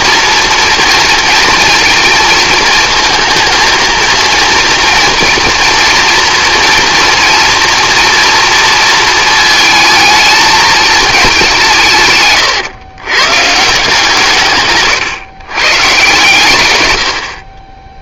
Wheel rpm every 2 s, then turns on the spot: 230, 230, 230, 230, 230, 220, 120, 140, 110.
14-16